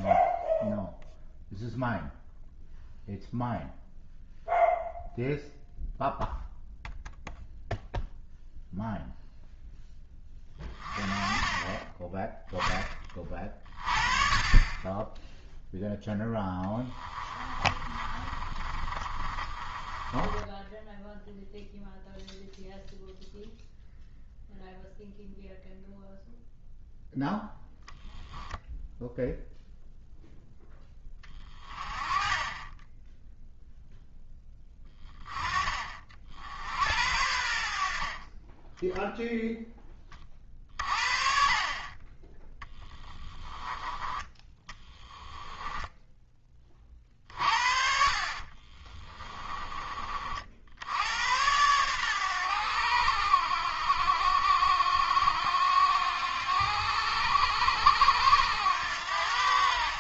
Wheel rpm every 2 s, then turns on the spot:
0, 0, 0, 0, 0, 30, 10, 20, 10, 30, 10, 0, 0, 0, 0, 10, 10, 10, 70, 10, 50, 10, 20, 30, 30, 80, 80, 60, 80, 90.
16-22 44-46 48-50